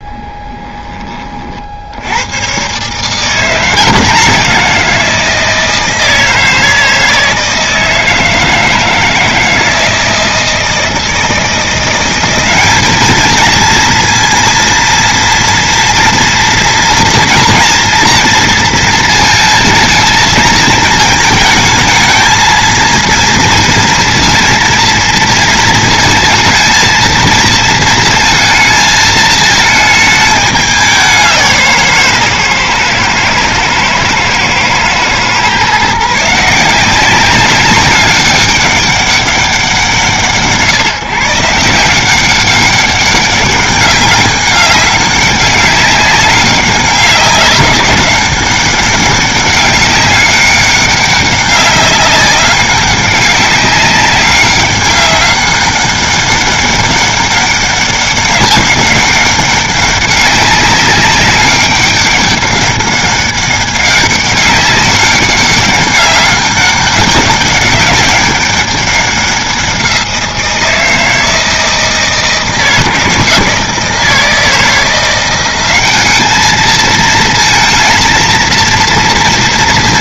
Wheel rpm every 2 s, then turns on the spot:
20, 130, 180, 160, 160, 160, 200, 230, 230, 230, 220, 220, 230, 230, 230, 200, 130, 120, 170, 200, 140, 200, 200, 200, 200, 200, 190, 200, 200, 200, 200, 200, 200, 200, 190, 170, 160, 170, 210, 230.
none